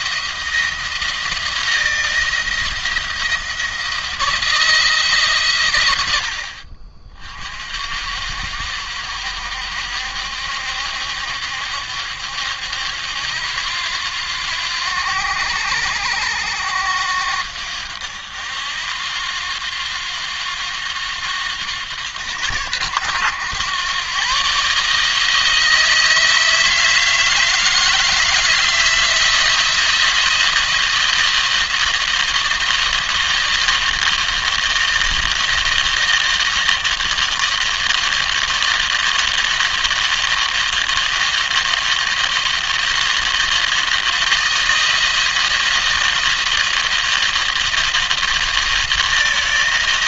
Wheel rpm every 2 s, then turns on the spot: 170, 170, 150, 40, 60, 70, 70, 80, 80, 80, 90, 100, 140, 160, 160, 170, 170, 160, 160, 160, 170, 170, 160, 170, 170.
none